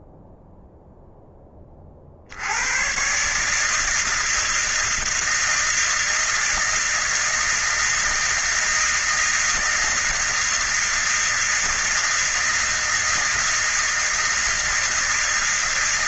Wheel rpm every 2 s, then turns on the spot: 0, 120, 160, 160, 160, 160, 160, 160.
none